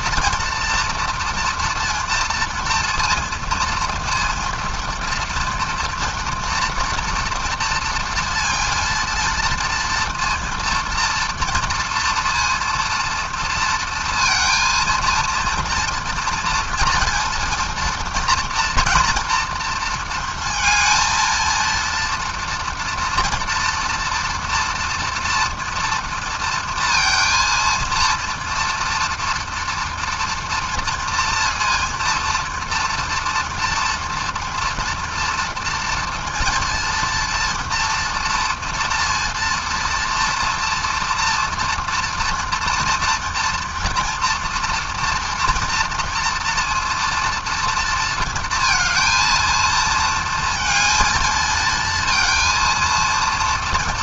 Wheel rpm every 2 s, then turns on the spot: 240, 230, 230, 240, 230, 240, 230, 230, 230, 230, 230, 240, 230, 230, 230, 230, 230, 230, 230, 230, 230, 230, 230, 230, 230, 220, 230.
none